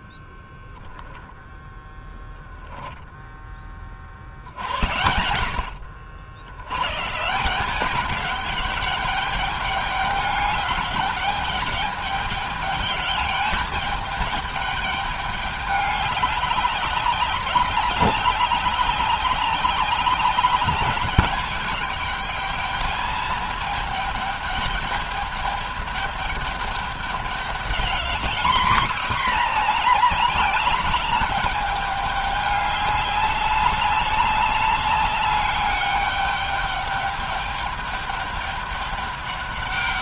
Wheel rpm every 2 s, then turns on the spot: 10, 0, 80, 100, 200, 210, 210, 210, 200, 190, 200, 210, 210, 200, 230, 210, 200, 200, 210, 200.
none